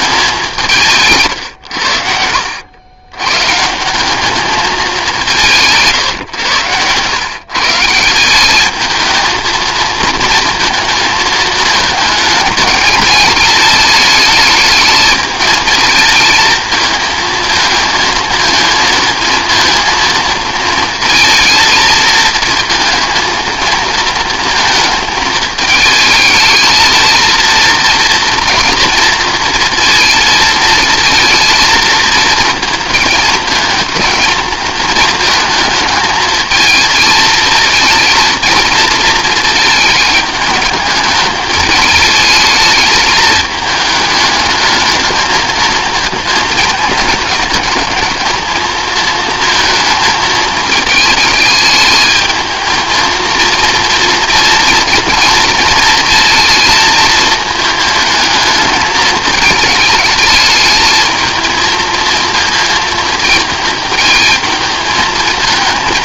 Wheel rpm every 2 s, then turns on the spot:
180, 70, 210, 110, 200, 230, 210, 220, 220, 220, 220, 220, 220, 220, 230, 230, 230, 220, 220, 230, 210, 220, 210, 220, 220, 220, 220, 230, 230, 220, 220, 220, 220.
none